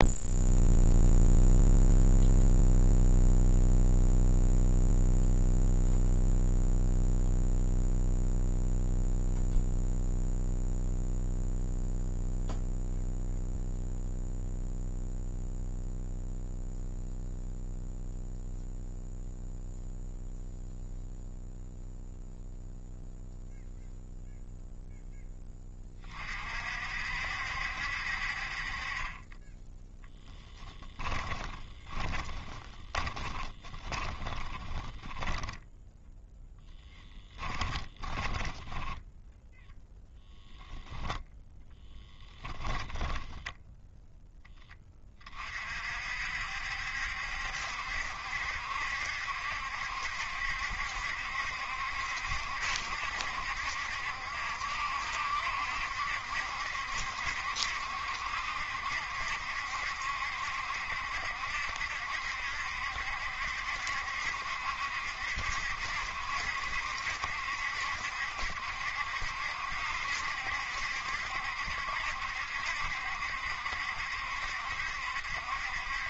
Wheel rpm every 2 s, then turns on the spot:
0, 0, 0, 0, 0, 0, 0, 0, 0, 0, 0, 0, 0, 50, 40, 10, 20, 20, 10, 10, 0, 10, 10, 60, 70, 70, 70, 70, 70, 70, 70, 70, 70, 70, 70, 70, 70, 70.
30-40 42-44